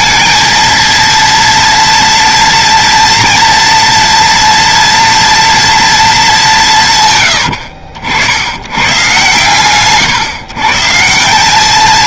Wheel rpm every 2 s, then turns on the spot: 230, 230, 230, 160, 100, 150.
none